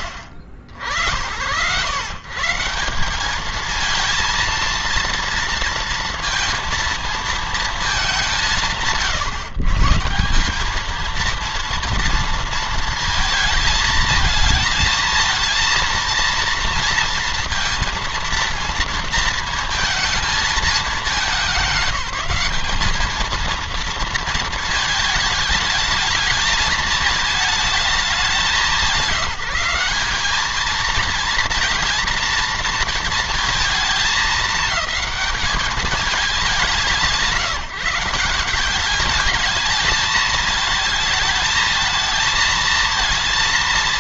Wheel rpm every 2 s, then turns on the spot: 80, 150, 230, 230, 150, 200, 230, 220, 230, 230, 200, 210, 220, 220, 180, 210, 230, 210, 170, 190, 220, 230.
none